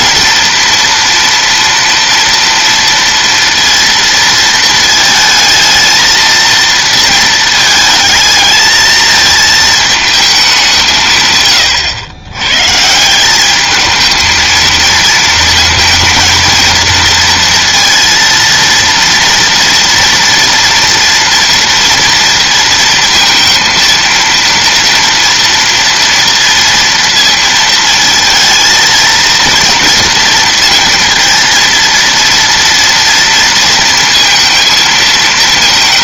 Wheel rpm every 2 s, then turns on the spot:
230, 230, 220, 230, 220, 190, 120, 230, 220, 230, 230, 230, 230, 230, 230, 230, 230, 220.
none